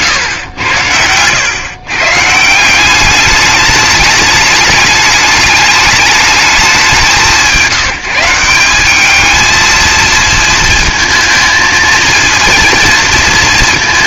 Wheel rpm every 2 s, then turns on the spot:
110, 160, 210, 200, 180, 220, 230.
none